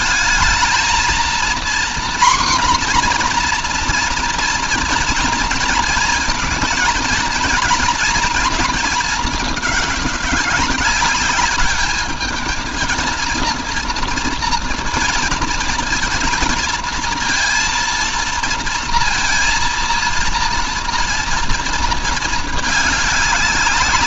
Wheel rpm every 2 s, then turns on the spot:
220, 250, 230, 230, 220, 200, 230, 230, 230, 230, 230, 200.
none